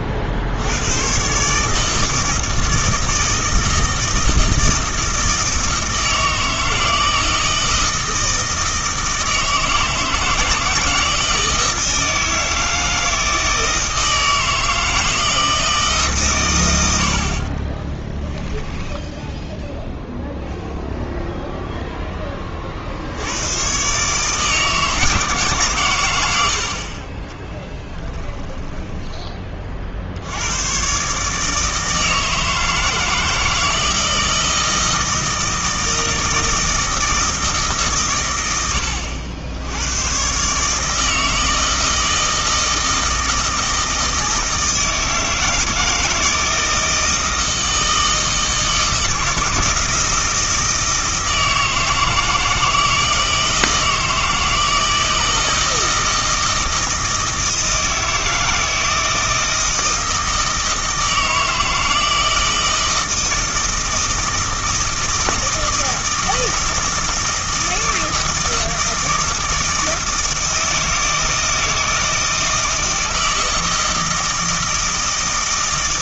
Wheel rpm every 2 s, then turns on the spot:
80, 160, 160, 160, 160, 170, 160, 160, 110, 10, 0, 40, 160, 70, 10, 110, 160, 160, 160, 80, 140, 160, 160, 160, 160, 160, 160, 160, 160, 160, 160, 160, 160, 160, 160, 160, 160, 160.
18-20 28-30